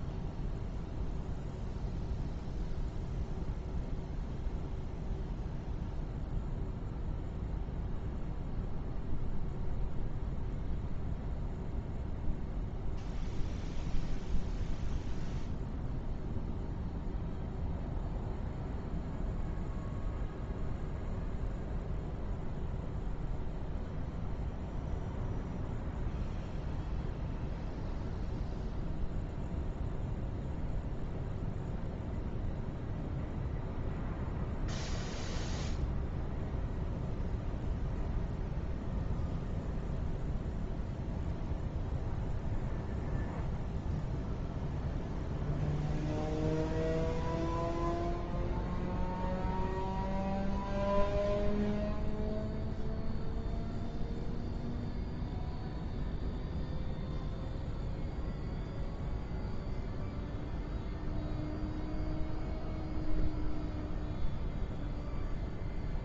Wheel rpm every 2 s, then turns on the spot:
0, 0, 0, 0, 0, 0, 0, 0, 0, 0, 0, 0, 0, 0, 0, 0, 0, 0, 0, 0, 0, 0, 0, 0, 0, 0, 0, 0, 0, 0, 0, 0, 0.
none